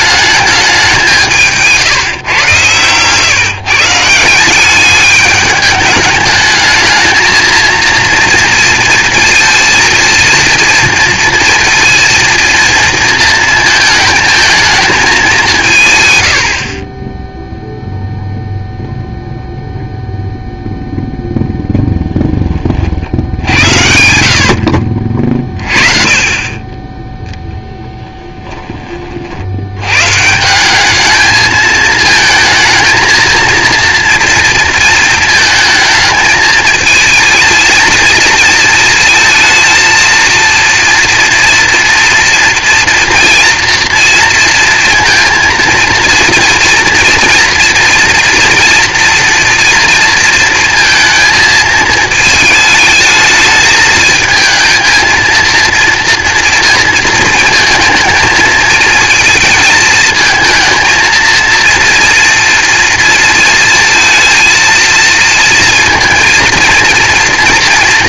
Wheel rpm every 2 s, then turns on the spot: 210, 120, 170, 220, 230, 230, 230, 220, 80, 0, 0, 20, 70, 30, 20, 160, 220, 230, 220, 230, 230, 230, 230, 230, 230, 230, 220, 220, 230, 220, 220, 230, 230, 230.
none